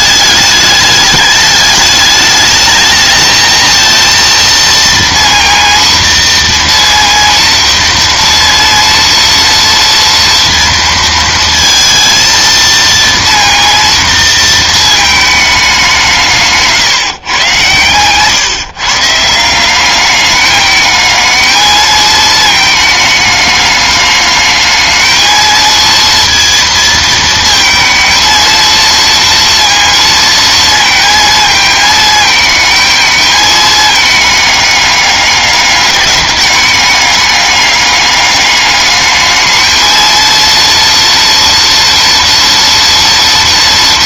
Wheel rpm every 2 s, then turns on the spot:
210, 220, 230, 230, 230, 230, 230, 220, 160, 140, 210, 220, 220, 230, 230, 230, 220, 210, 200, 210, 230, 230.
none